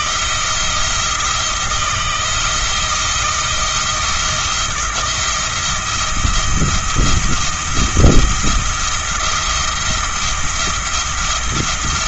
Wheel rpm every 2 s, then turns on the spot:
170, 170, 170, 170, 170, 170.
none